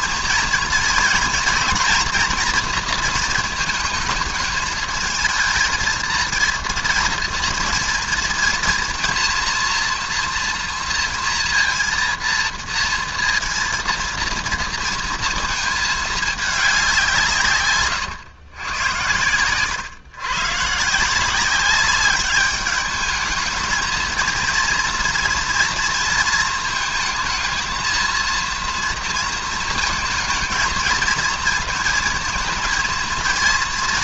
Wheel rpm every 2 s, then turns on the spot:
230, 240, 220, 230, 230, 230, 230, 230, 210, 120, 120, 200, 230, 220, 230, 230, 230.
none